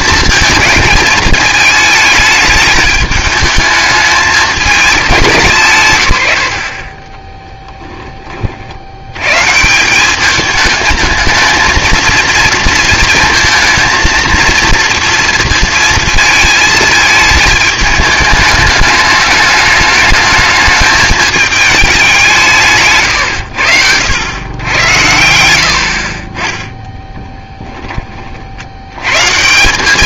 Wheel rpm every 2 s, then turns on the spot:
220, 210, 200, 50, 70, 220, 230, 230, 220, 210, 210, 150, 100, 10, 80.
none